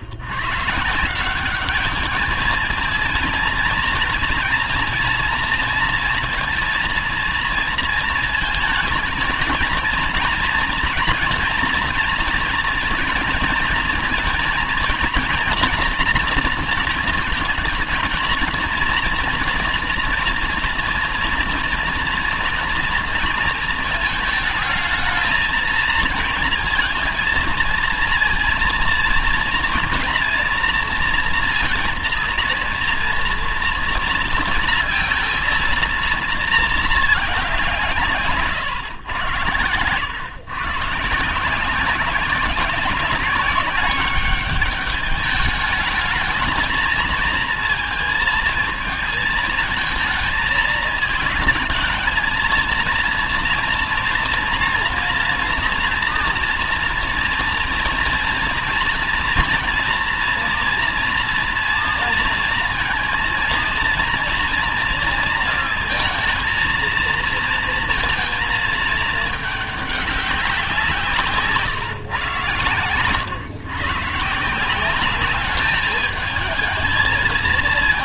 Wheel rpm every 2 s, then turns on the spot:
110, 220, 230, 230, 220, 230, 230, 230, 230, 230, 230, 230, 220, 230, 230, 230, 230, 230, 220, 130, 140, 190, 200, 220, 220, 220, 230, 230, 230, 230, 230, 230, 230, 220, 220, 190, 120, 160, 210.
none